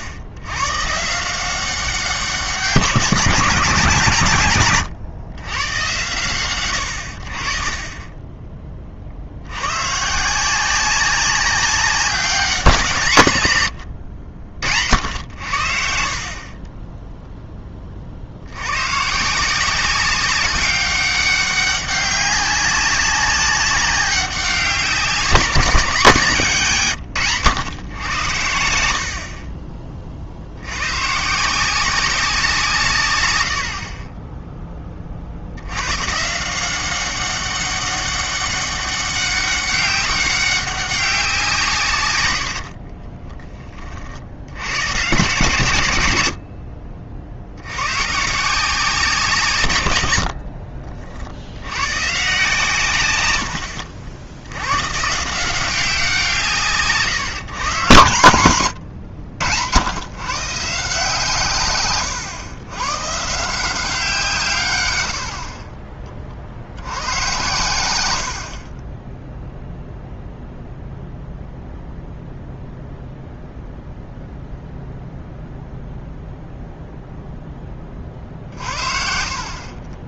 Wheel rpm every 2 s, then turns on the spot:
150, 170, 130, 80, 30, 190, 170, 70, 20, 100, 190, 200, 190, 150, 80, 90, 170, 20, 170, 200, 200, 70, 90, 40, 170, 50, 130, 100, 160, 120, 160, 120, 130, 80, 40, 0, 0, 0, 0, 50.
16-18 42-44 50-52